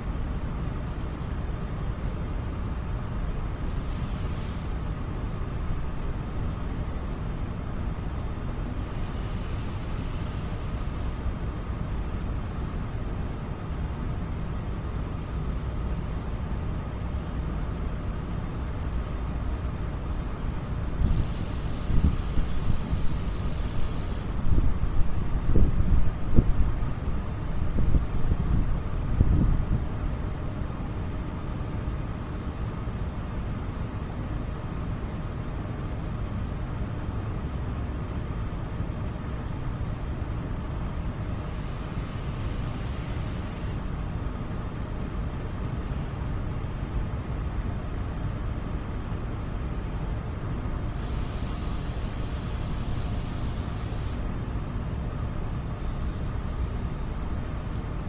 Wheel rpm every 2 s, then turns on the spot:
0, 0, 0, 0, 0, 0, 0, 0, 0, 0, 0, 0, 0, 0, 0, 0, 0, 0, 0, 0, 0, 0, 0, 0, 0, 0, 0, 0, 0.
none